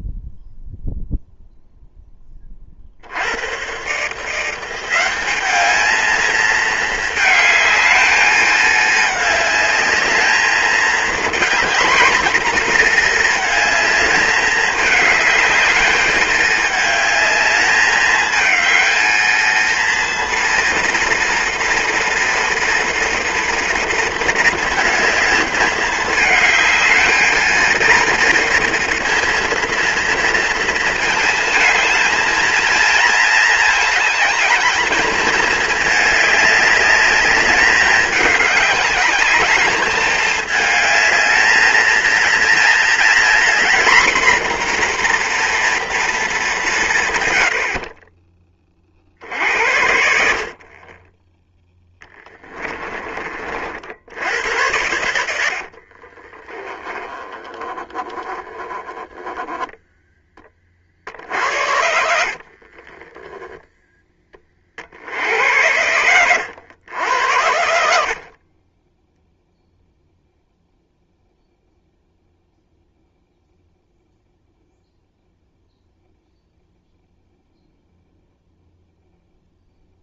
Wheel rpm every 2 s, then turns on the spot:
0, 40, 170, 220, 220, 220, 230, 210, 220, 220, 230, 240, 230, 220, 230, 230, 220, 220, 210, 210, 220, 230, 240, 210, 30, 40, 20, 90, 20, 20, 30, 40, 40, 90, 30, 0, 0, 0, 0, 0.
52-54 56-58 62-64 68-70